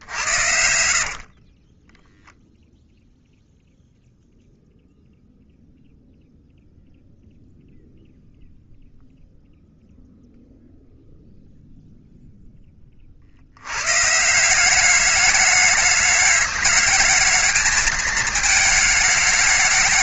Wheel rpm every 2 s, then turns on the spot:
80, 0, 0, 0, 0, 0, 10, 180, 210, 220.
0-2